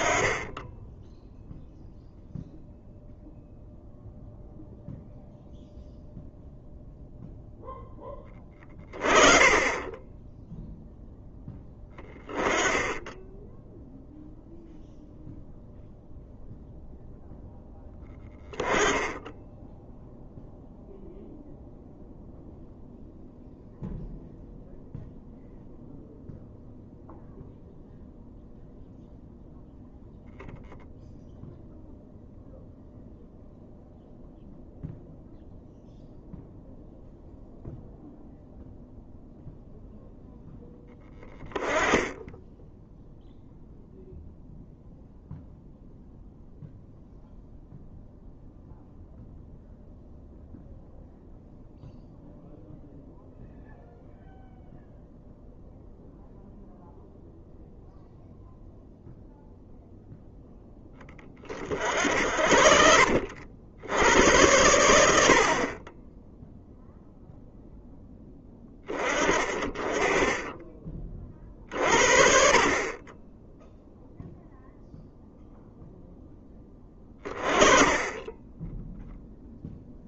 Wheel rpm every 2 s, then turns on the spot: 10, 0, 0, 0, 20, 0, 10, 0, 0, 10, 0, 0, 0, 0, 0, 0, 0, 0, 0, 0, 0, 0, 0, 0, 0, 0, 0, 0, 0, 0, 10, 60, 90, 0, 20, 20, 20, 0, 10, 10.
none